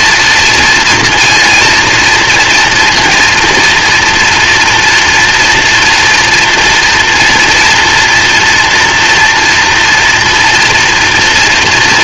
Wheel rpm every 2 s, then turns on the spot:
230, 230, 230, 240, 240, 230.
none